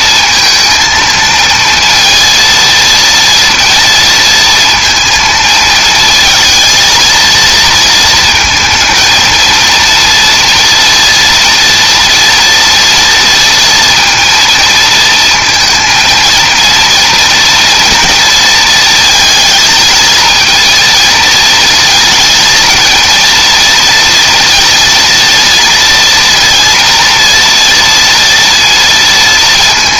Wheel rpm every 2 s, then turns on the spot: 230, 230, 230, 230, 230, 230, 230, 230, 230, 220, 230, 230, 230, 230, 230.
none